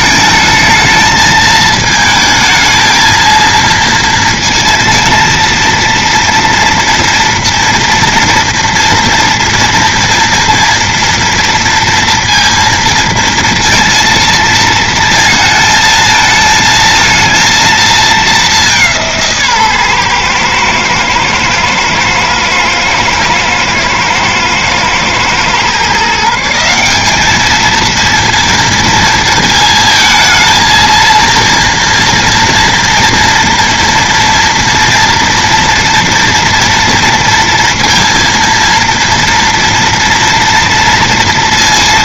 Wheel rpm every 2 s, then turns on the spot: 230, 220, 230, 230, 230, 230, 230, 230, 230, 190, 120, 110, 110, 180, 230, 220, 230, 230, 230, 230, 230.
none